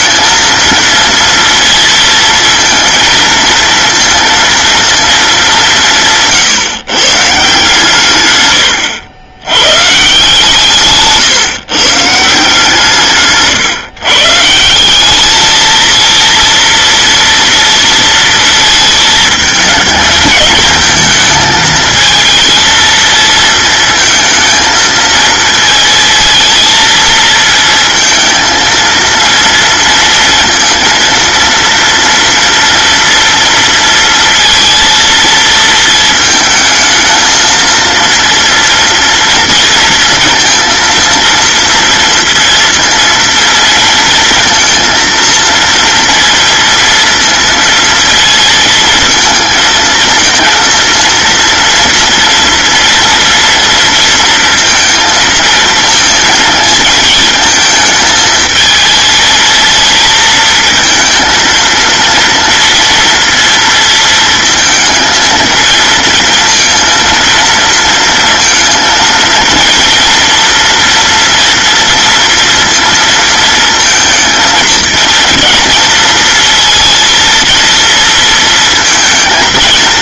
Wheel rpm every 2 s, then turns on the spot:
220, 230, 230, 150, 100, 150, 160, 170, 230, 220, 220, 230, 230, 230, 230, 230, 230, 230, 220, 230, 230, 230, 230, 230, 230, 230, 230, 230, 220, 220, 220, 230, 230, 230, 230, 230, 230, 220, 230, 230.
8-10